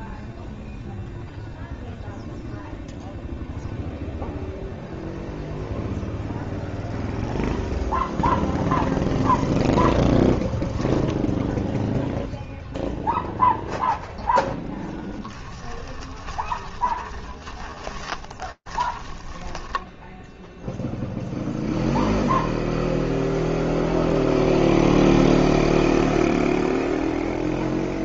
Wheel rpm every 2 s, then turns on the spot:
0, 0, 0, 0, 0, 0, 10, 20, 30, 10, 0, 0, 0, 0.
12-18